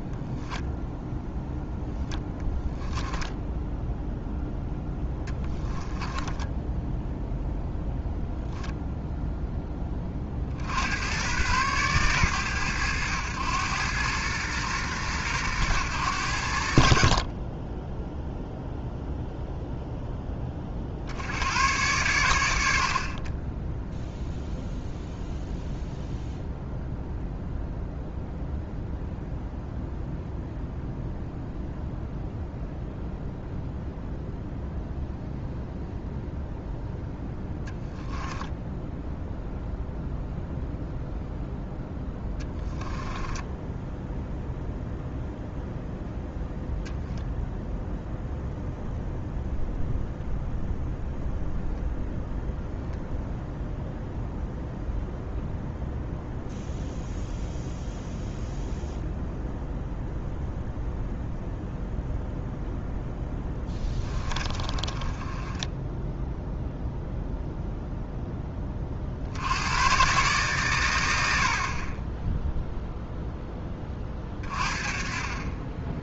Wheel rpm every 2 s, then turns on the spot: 0, 10, 10, 10, 0, 60, 90, 120, 50, 0, 50, 50, 0, 0, 0, 0, 0, 0, 0, 10, 0, 10, 0, 0, 0, 0, 0, 0, 0, 0, 0, 0, 20, 0, 30, 110, 0, 30.
2-4 42-44 64-66